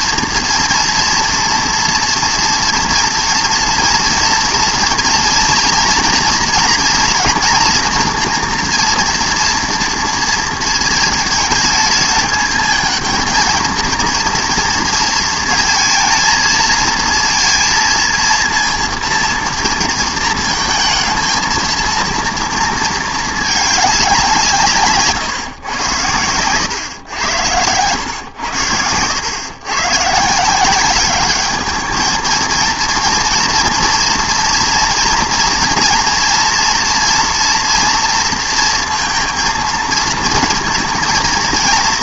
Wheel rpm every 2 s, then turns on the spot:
230, 230, 230, 230, 240, 230, 220, 230, 230, 230, 220, 230, 170, 110, 100, 170, 230, 230, 230, 230, 230.
28-30